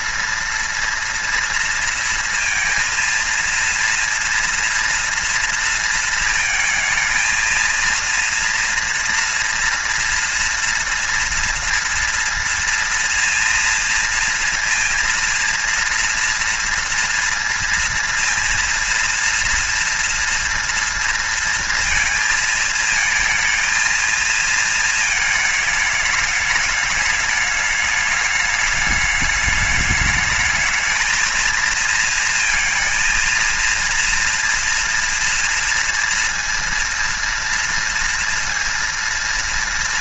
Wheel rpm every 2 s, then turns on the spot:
230, 230, 230, 220, 230, 230, 230, 230, 230, 230, 230, 230, 230, 210, 210, 220, 230, 230, 230, 230.
none